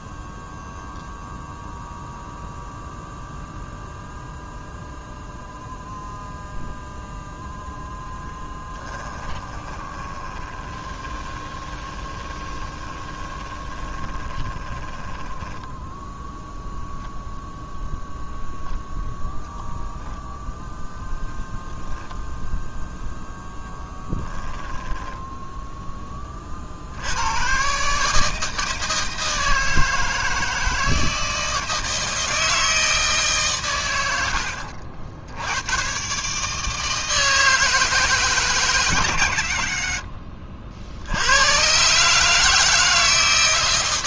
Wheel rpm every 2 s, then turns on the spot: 0, 0, 0, 0, 10, 20, 20, 20, 0, 0, 0, 0, 10, 60, 160, 160, 160, 80, 160, 130, 60, 160.
8-16 24-26